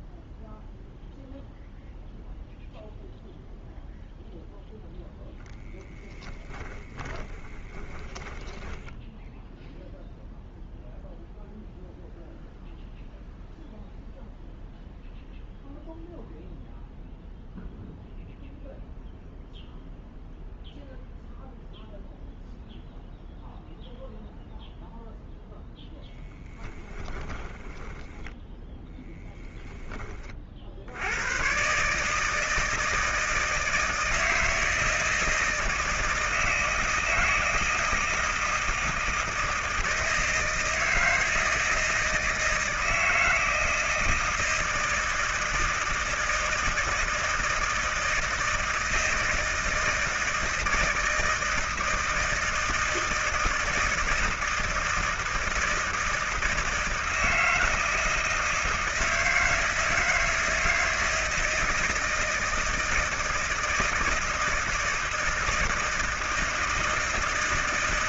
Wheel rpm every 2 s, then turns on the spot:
0, 0, 0, 10, 10, 0, 0, 0, 0, 0, 0, 0, 0, 10, 10, 50, 160, 160, 160, 160, 160, 160, 160, 160, 160, 160, 160, 160, 160, 160, 160, 160, 160, 160.
6-10 26-30